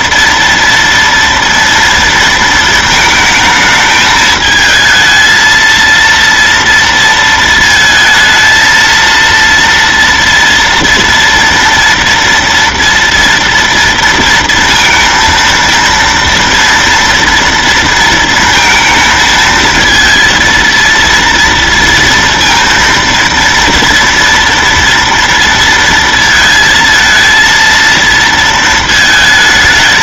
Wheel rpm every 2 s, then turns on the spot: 230, 230, 220, 230, 230, 230, 230, 230, 230, 220, 230, 230, 230, 230, 230.
none